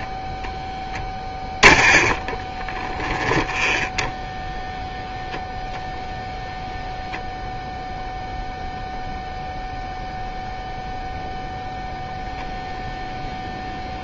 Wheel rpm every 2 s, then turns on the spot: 0, 10, 0, 0, 0, 0, 0.
2-4